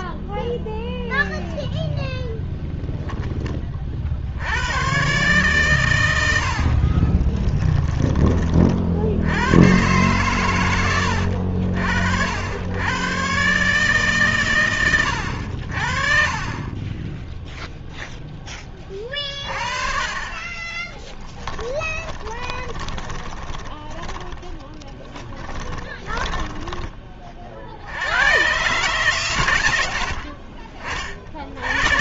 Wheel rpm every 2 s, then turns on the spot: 0, 0, 120, 40, 70, 80, 110, 100, 20, 30, 20, 20, 20, 20, 140, 40.
6-8 20-28